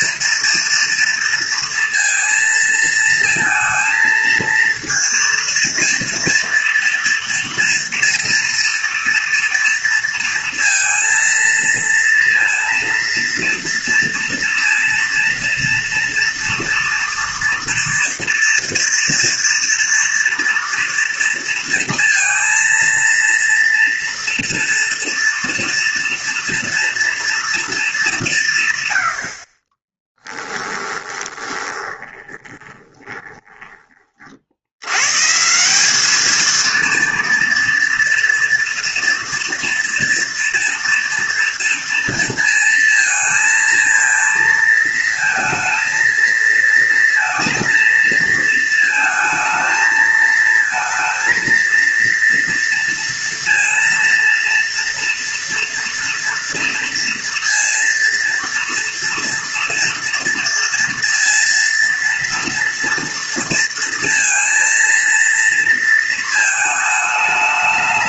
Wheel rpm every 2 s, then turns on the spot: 230, 230, 230, 230, 230, 230, 230, 230, 230, 230, 230, 230, 230, 230, 110, 20, 20, 90, 230, 230, 240, 230, 220, 230, 220, 220, 230, 230, 230, 230, 230, 230, 230, 220.
30-34